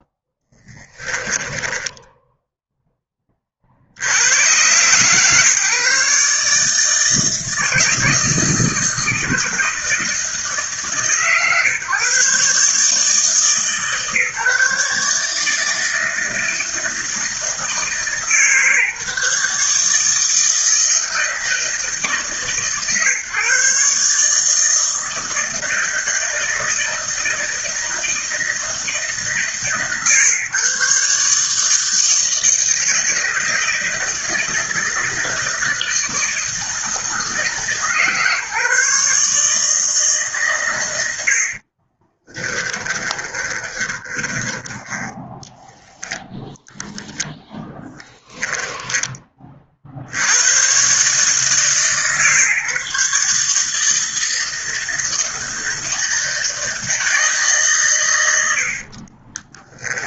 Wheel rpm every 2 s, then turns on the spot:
10, 0, 130, 160, 160, 140, 150, 150, 160, 150, 160, 140, 160, 160, 160, 140, 160, 160, 160, 140, 100, 30, 10, 0, 10, 130, 140, 160, 160, 40.
0-2 42-44 58-60